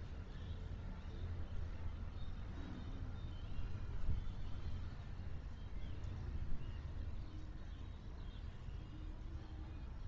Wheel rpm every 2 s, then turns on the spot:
0, 0, 0, 0, 0.
none